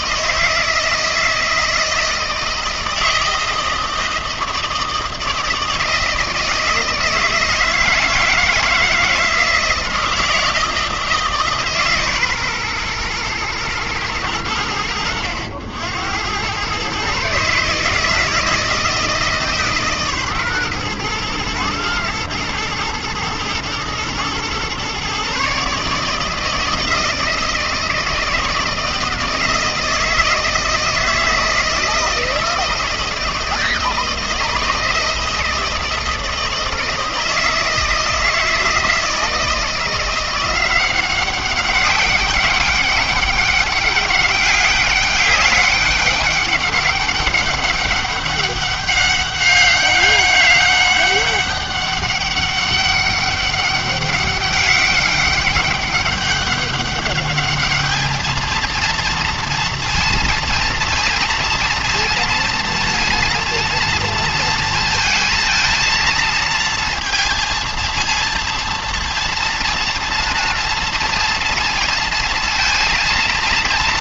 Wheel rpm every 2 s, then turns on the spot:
160, 160, 160, 160, 160, 160, 130, 80, 100, 160, 130, 110, 120, 160, 160, 160, 160, 160, 160, 160, 180, 200, 200, 200, 200, 200, 200, 200, 200, 220, 230, 230, 230, 230, 230, 230, 230.
none